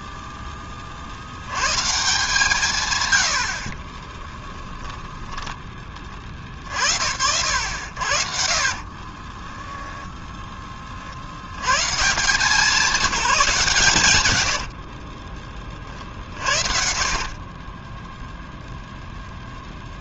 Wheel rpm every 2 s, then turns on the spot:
30, 110, 10, 50, 40, 40, 190, 40, 50, 0.
4-6 8-10 14-18